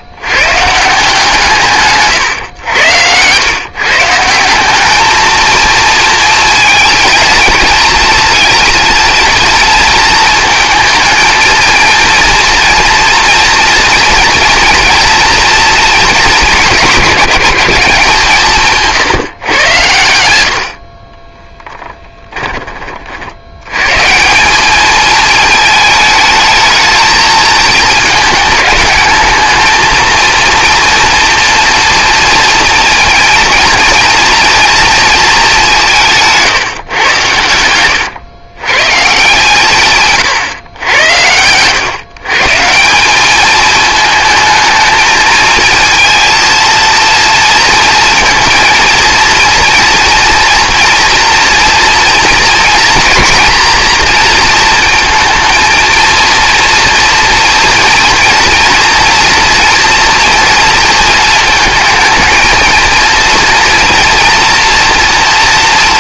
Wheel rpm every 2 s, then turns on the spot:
160, 100, 210, 230, 230, 230, 230, 230, 200, 160, 50, 30, 210, 220, 220, 230, 230, 230, 130, 140, 110, 170, 220, 230, 230, 230, 230, 230, 230, 240, 230, 230, 230.
2-4 20-22